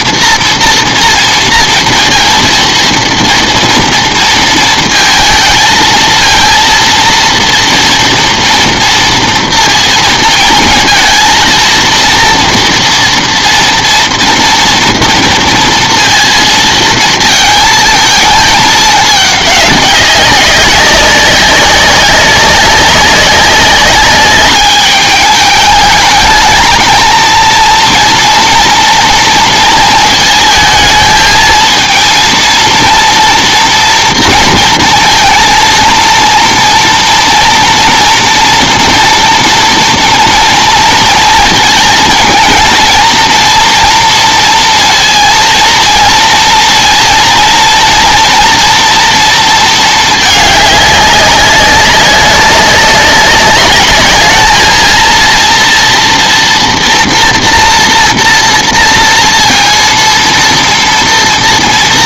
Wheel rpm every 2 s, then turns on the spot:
230, 230, 230, 230, 230, 230, 230, 230, 230, 210, 190, 190, 210, 220, 230, 220, 230, 230, 230, 230, 230, 230, 230, 230, 230, 210, 200, 220, 240, 230, 230.
none